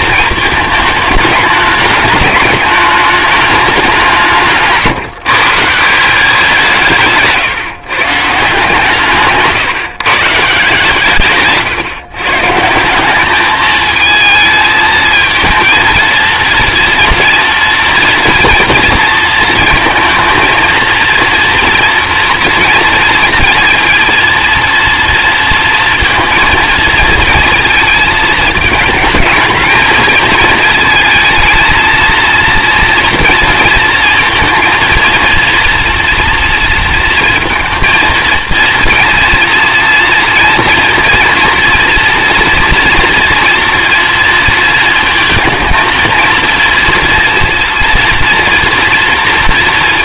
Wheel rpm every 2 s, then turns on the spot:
220, 210, 160, 170, 150, 160, 160, 220, 230, 230, 230, 230, 230, 220, 220, 220, 230, 230, 230, 230, 230, 230, 220, 230, 230.
none